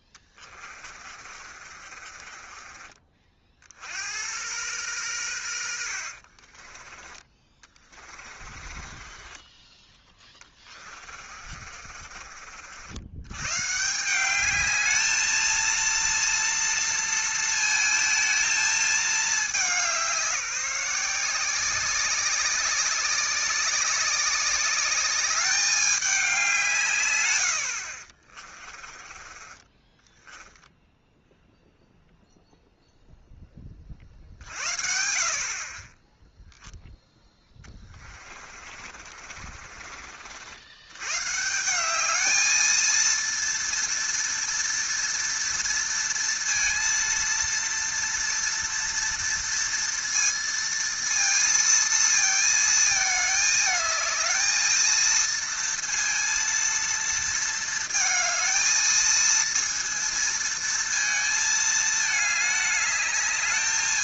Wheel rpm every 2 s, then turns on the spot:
30, 30, 110, 40, 30, 20, 60, 210, 230, 220, 190, 190, 200, 170, 30, 10, 0, 60, 0, 40, 90, 220, 230, 230, 230, 230, 220, 220, 230, 220, 230, 210.
0-4 6-12 28-32 38-40